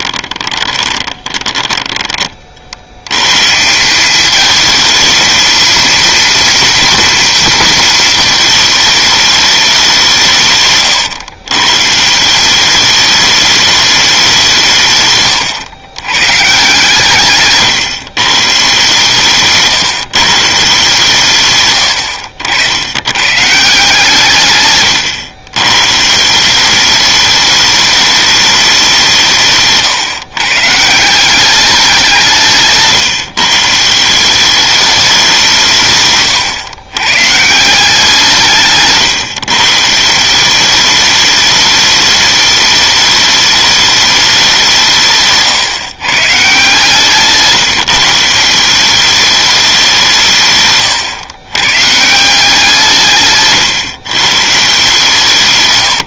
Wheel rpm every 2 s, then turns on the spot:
20, 80, 220, 240, 220, 130, 200, 150, 140, 140, 150, 90, 120, 200, 190, 150, 150, 200, 120, 140, 200, 210, 170, 150, 190, 130, 170, 150.
0-2 24-26 38-40